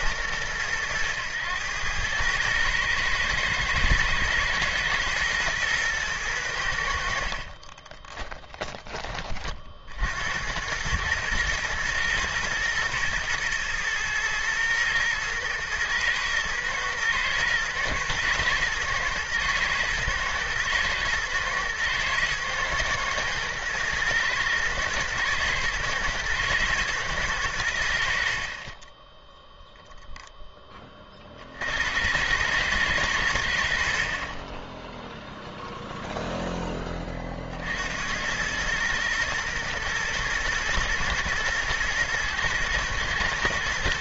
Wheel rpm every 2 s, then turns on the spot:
110, 110, 110, 80, 20, 100, 110, 110, 120, 120, 120, 120, 120, 120, 20, 20, 110, 10, 10, 110, 120, 110.
none